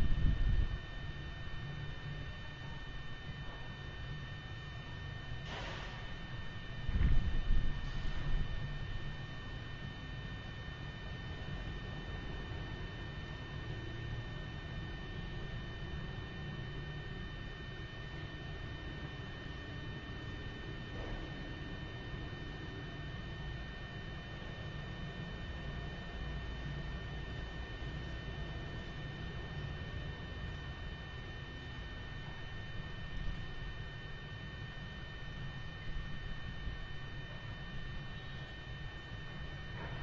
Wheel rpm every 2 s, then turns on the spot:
0, 0, 0, 0, 0, 0, 0, 0, 0, 0, 0, 0, 0, 0, 0, 0, 0, 0, 0, 0.
none